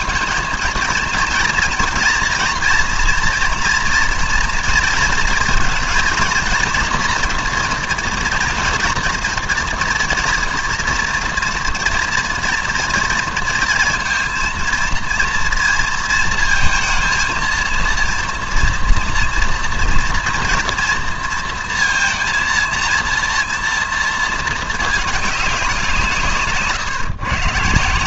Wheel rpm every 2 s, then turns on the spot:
220, 230, 230, 230, 240, 230, 240, 230, 230, 230, 230, 230, 220, 140.
none